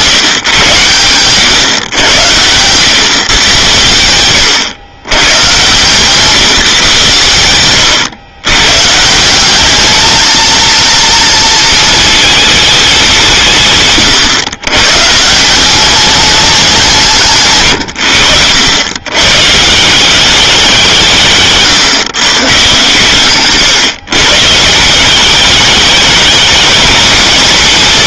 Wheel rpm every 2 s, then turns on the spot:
120, 110, 100, 150, 120, 230, 220, 120, 190, 80, 180, 140, 150, 210.
none